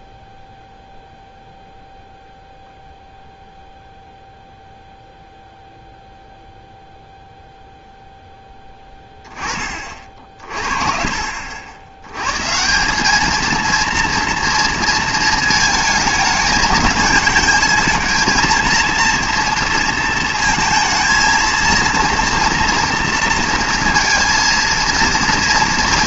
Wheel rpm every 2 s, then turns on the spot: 0, 0, 0, 0, 10, 50, 160, 230, 220, 230, 220, 230, 230.
none